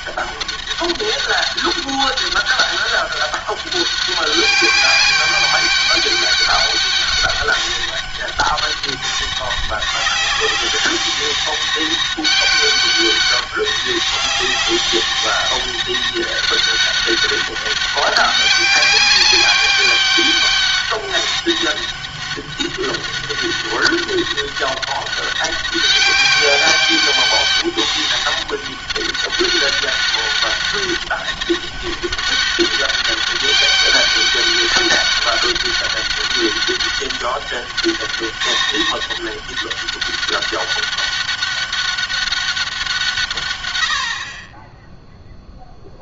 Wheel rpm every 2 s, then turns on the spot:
200, 200, 200, 200, 200, 200, 200, 200, 190, 200, 200, 200, 200, 200, 200, 200, 200, 200, 200, 200, 200, 190, 40.
none